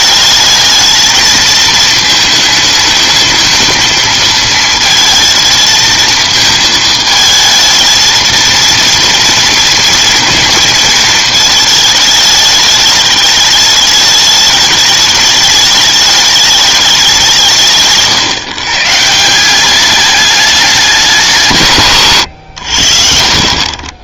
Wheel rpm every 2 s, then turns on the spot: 220, 220, 220, 220, 230, 230, 210, 210, 210, 130, 210, 90.
none